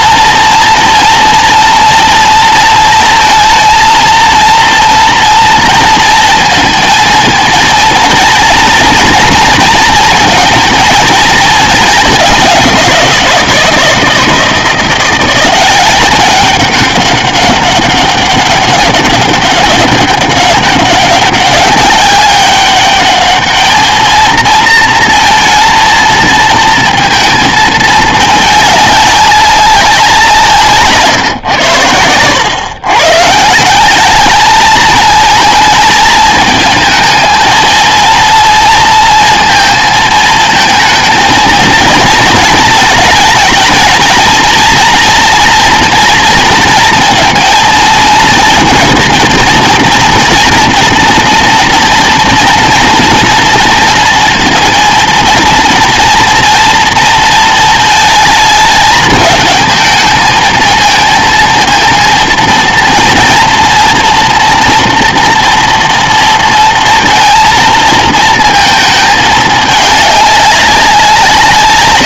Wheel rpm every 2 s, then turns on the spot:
230, 230, 230, 230, 230, 230, 180, 170, 200, 200, 200, 200, 230, 230, 210, 140, 130, 220, 220, 230, 220, 220, 230, 230, 230, 230, 240, 230, 240, 210, 220, 230, 240, 230, 220, 190.
none